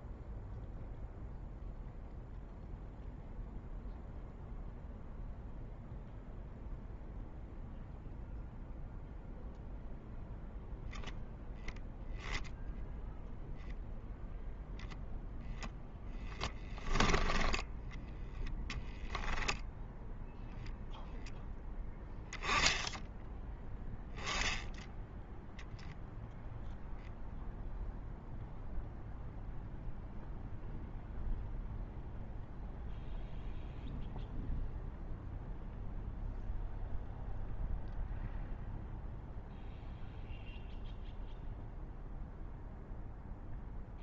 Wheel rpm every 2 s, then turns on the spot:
0, 0, 0, 0, 0, 0, 0, 0, 20, 0, 10, 10, 0, 0, 0, 0, 0, 0, 0, 0, 0, 0.
none